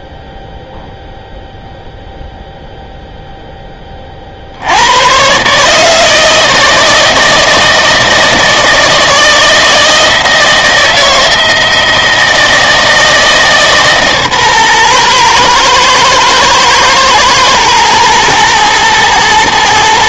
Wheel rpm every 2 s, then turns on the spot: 0, 0, 80, 160, 160, 160, 160, 130, 110, 110.
none